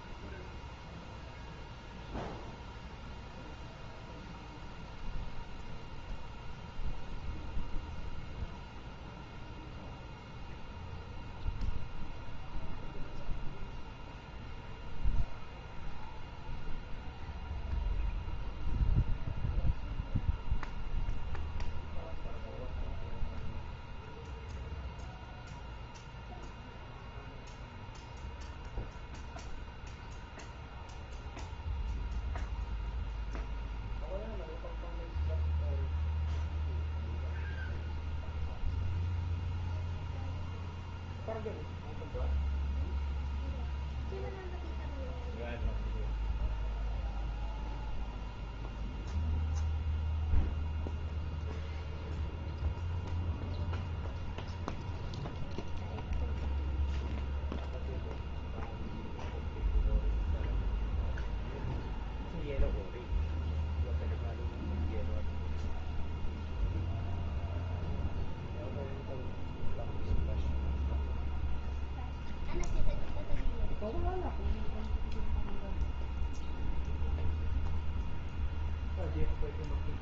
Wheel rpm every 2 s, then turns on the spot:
0, 0, 0, 0, 0, 0, 0, 0, 0, 0, 0, 0, 0, 0, 0, 0, 0, 0, 0, 0, 0, 0, 0, 0, 0, 0, 0, 0, 0, 0, 0, 0, 0, 0, 0, 0, 0, 0, 0, 0.
none